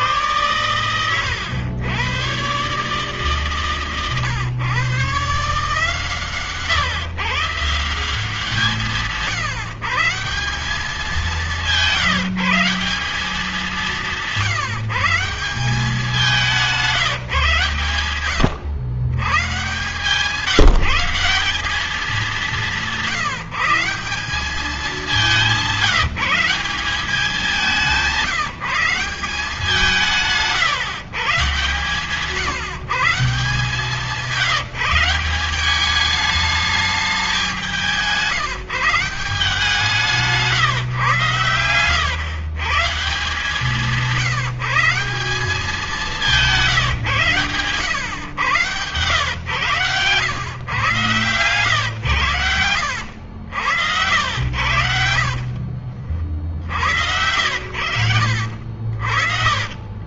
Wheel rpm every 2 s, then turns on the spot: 120, 140, 120, 130, 180, 190, 170, 160, 180, 120, 170, 180, 200, 180, 180, 150, 150, 180, 210, 170, 130, 130, 170, 160, 110, 120, 80, 80, 40, 50.
46-48 52-56